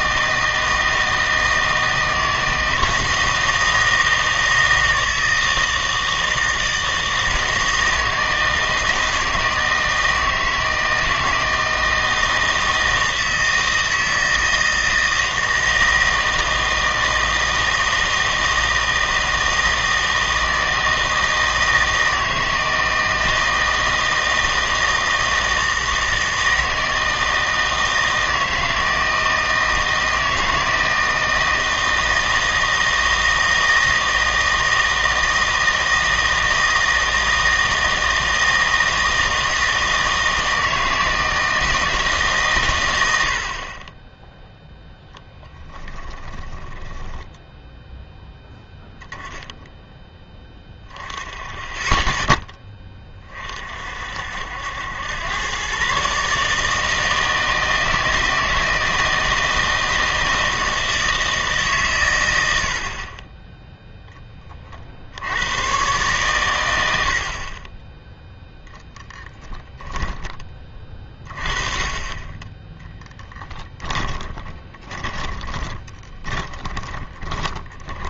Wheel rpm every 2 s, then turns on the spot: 160, 160, 160, 160, 160, 160, 160, 160, 160, 160, 160, 160, 160, 160, 160, 160, 160, 160, 160, 160, 160, 120, 0, 10, 0, 10, 10, 80, 150, 160, 160, 80, 30, 100, 0, 30, 10, 20, 20.
46-48 74-78